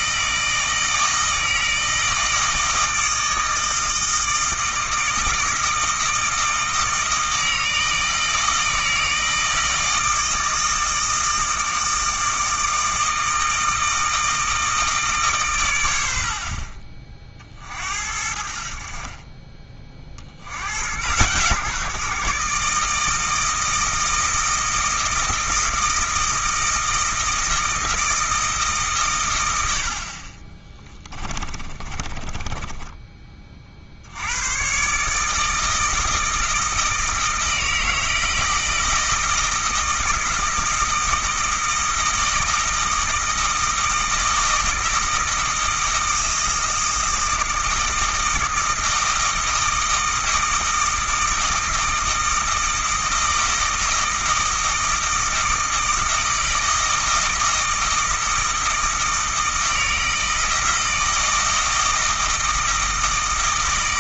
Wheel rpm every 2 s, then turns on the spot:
160, 160, 160, 160, 160, 160, 160, 160, 50, 60, 90, 150, 160, 160, 150, 20, 20, 120, 160, 160, 160, 160, 160, 160, 160, 160, 160, 160, 160, 160, 160, 160.
30-34